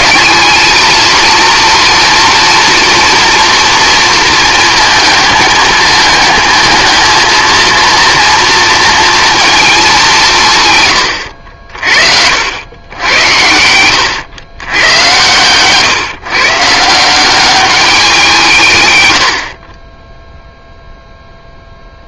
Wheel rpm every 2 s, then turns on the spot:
220, 230, 220, 220, 230, 140, 90, 100, 150, 160, 0.
none